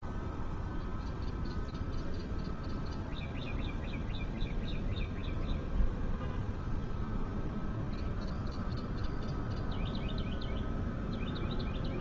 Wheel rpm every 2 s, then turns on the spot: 0, 0, 0, 0, 0, 0.
none